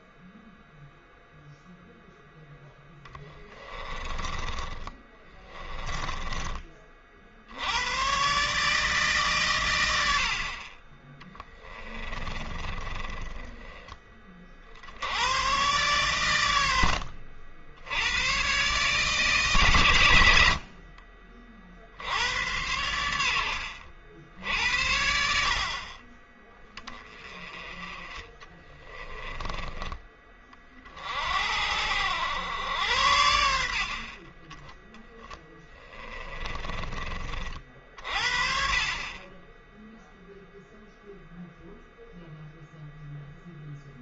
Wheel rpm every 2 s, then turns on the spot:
0, 10, 20, 40, 150, 40, 20, 70, 80, 130, 50, 90, 70, 20, 20, 40, 90, 10, 20, 40, 0, 0.
2-6 10-14 16-18 20-22 36-38